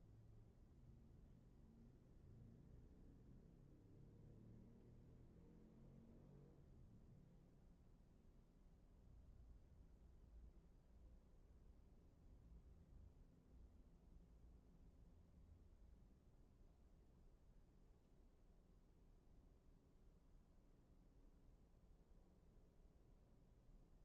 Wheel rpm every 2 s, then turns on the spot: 0, 0, 0, 0, 0, 0, 0, 0, 0, 0, 0, 0.
none